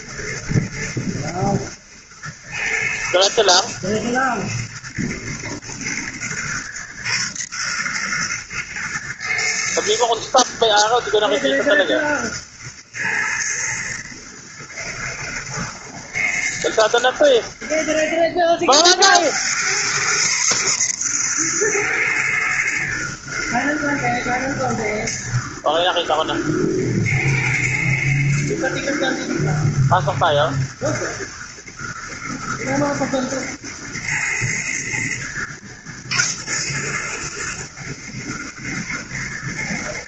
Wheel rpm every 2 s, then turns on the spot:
120, 120, 120, 120, 120, 110, 110, 110, 120, 60, 110, 120, 120, 120, 110, 120, 110, 120, 120, 110.
none